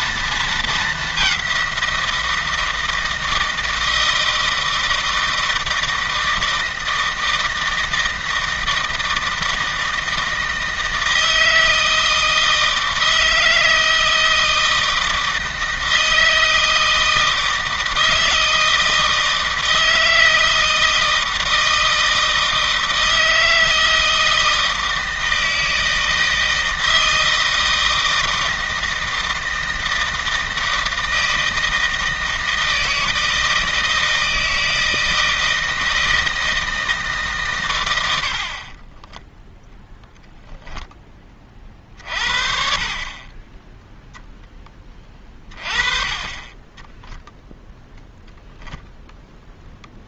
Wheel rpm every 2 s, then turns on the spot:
210, 160, 160, 160, 160, 160, 160, 160, 160, 160, 160, 160, 160, 160, 160, 160, 160, 160, 160, 30, 20, 40, 10, 10, 0.
38-42